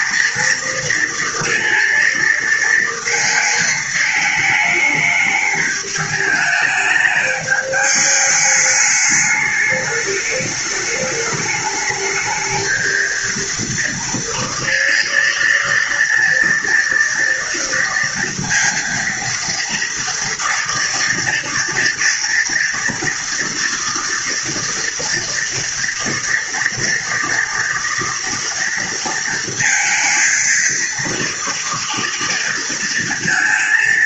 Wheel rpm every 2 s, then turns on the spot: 230, 230, 220, 210, 210, 210, 220, 230, 230, 230, 230, 240, 230, 230, 230, 230, 230.
none